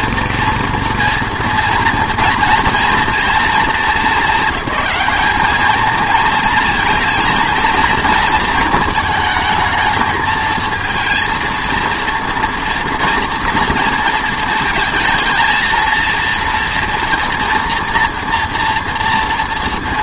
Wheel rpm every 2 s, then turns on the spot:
230, 230, 210, 230, 230, 230, 240, 220, 240, 230.
none